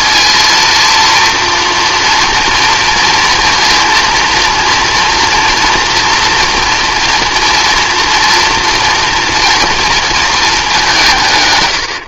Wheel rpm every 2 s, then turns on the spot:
230, 230, 230, 240, 230, 200.
none